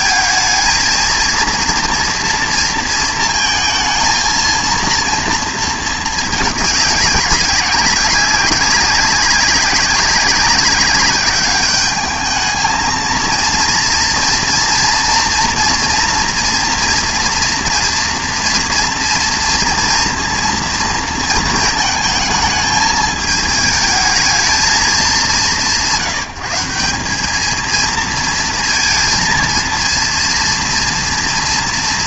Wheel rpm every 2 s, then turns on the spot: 220, 230, 230, 210, 200, 200, 220, 240, 240, 230, 230, 220, 220, 180, 230, 230.
none